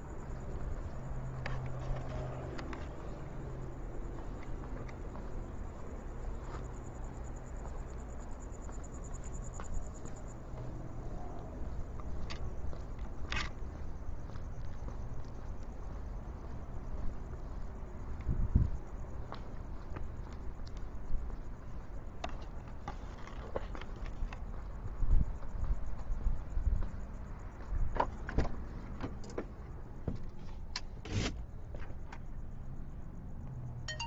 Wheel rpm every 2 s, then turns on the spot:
0, 0, 0, 0, 0, 0, 0, 0, 0, 0, 0, 0, 0, 0, 0, 0, 0.
none